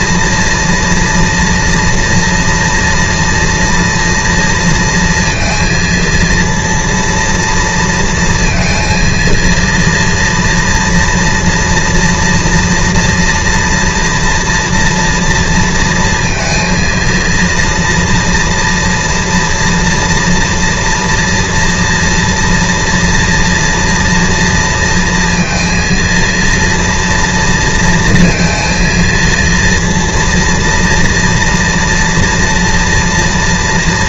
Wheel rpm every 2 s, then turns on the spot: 240, 230, 230, 230, 230, 230, 240, 240, 230, 230, 230, 230, 230, 230, 230, 230, 230.
none